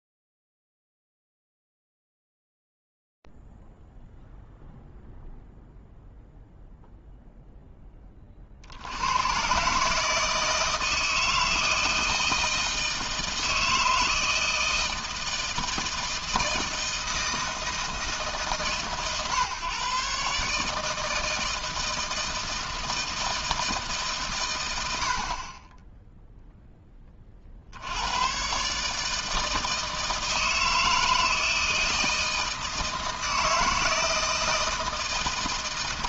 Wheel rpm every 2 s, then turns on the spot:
0, 0, 0, 0, 30, 160, 160, 160, 160, 140, 140, 160, 100, 10, 150, 160, 160, 160.
none